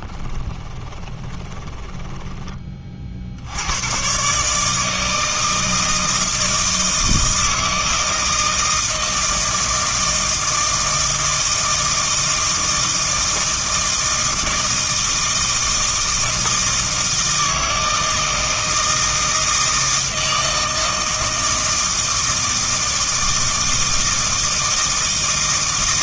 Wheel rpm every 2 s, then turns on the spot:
30, 30, 150, 160, 160, 160, 160, 160, 160, 160, 160, 160, 160.
0-2